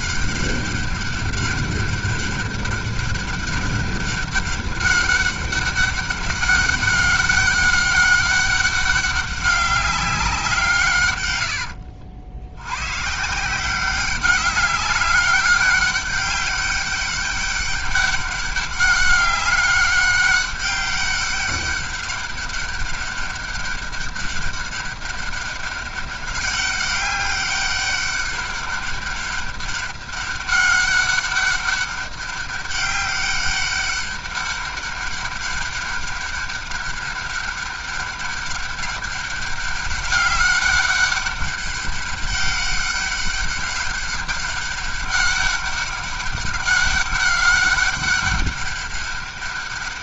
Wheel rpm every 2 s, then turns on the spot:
200, 200, 200, 200, 200, 170, 90, 200, 200, 200, 200, 200, 200, 200, 200, 200, 200, 200, 200, 200, 200, 200, 200, 200, 200.
none